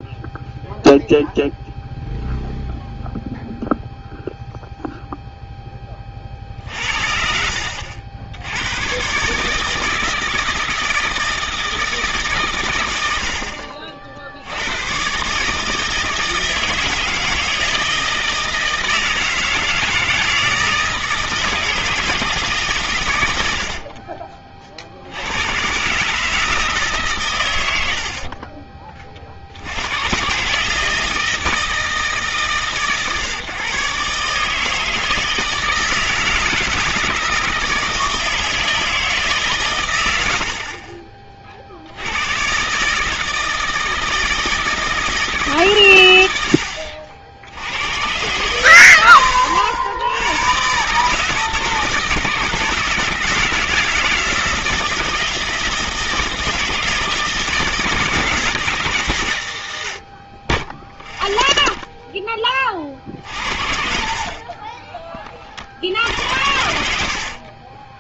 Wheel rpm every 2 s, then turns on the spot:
0, 0, 0, 50, 100, 160, 120, 90, 160, 160, 160, 140, 40, 150, 20, 150, 140, 150, 160, 160, 60, 130, 160, 80, 110, 130, 160, 160, 160, 160, 20, 30, 30, 70.
6-8 40-42 64-66